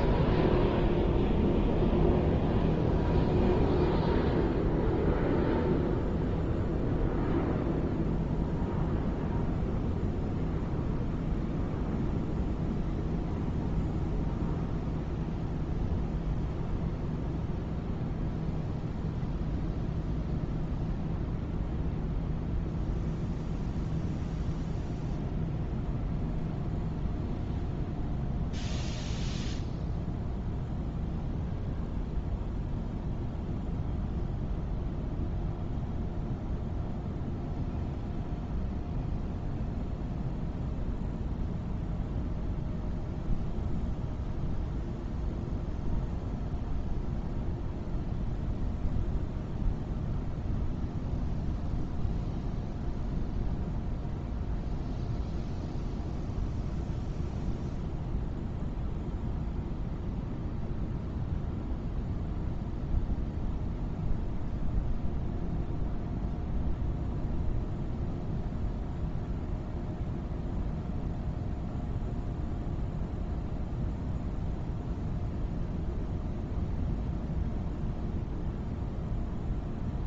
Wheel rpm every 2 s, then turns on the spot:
0, 0, 0, 0, 0, 0, 0, 0, 0, 0, 0, 0, 0, 0, 0, 0, 0, 0, 0, 0, 0, 0, 0, 0, 0, 0, 0, 0, 0, 0, 0, 0, 0, 0, 0, 0, 0, 0, 0, 0.
none